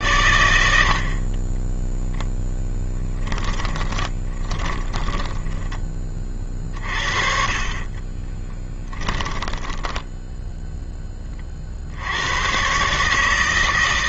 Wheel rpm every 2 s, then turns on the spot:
80, 10, 10, 40, 10, 0, 130.
2-6 8-10